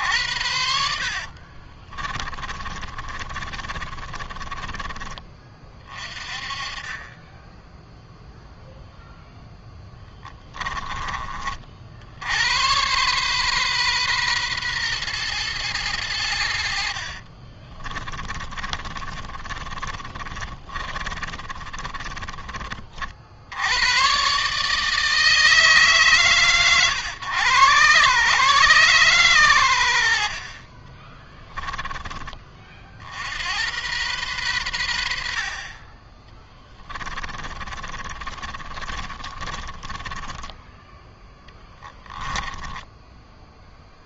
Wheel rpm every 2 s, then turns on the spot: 70, 30, 20, 30, 0, 20, 110, 120, 70, 30, 30, 40, 150, 130, 140, 40, 40, 110, 20, 30, 10, 10.
0-6 16-22 30-32 36-44